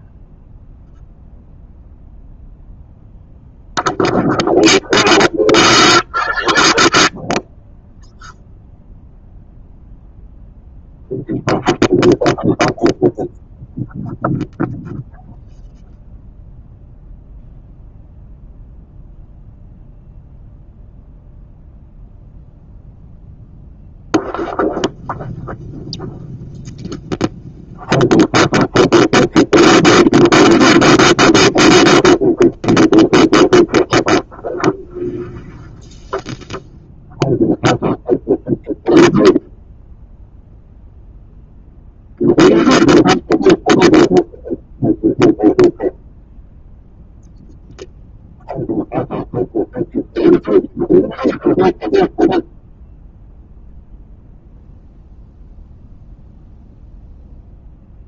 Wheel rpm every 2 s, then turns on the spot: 0, 0, 0, 0, 0, 0, 0, 0, 0, 0, 0, 0, 0, 0, 0, 0, 0, 0, 0, 0, 0, 0, 0, 0, 0, 0, 0, 0, 0.
none